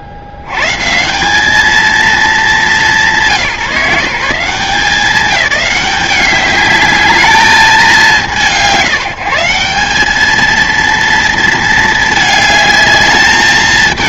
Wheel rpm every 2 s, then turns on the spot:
70, 190, 160, 210, 160, 220, 220.
none